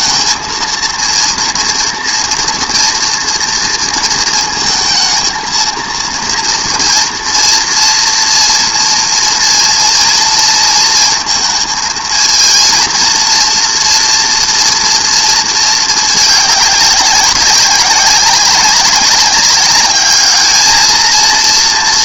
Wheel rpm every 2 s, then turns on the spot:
230, 230, 220, 230, 230, 230, 230, 230, 200, 200, 220.
none